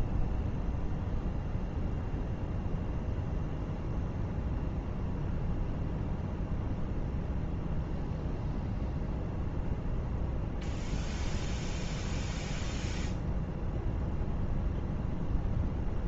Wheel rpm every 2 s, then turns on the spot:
0, 0, 0, 0, 0, 0, 0, 0.
none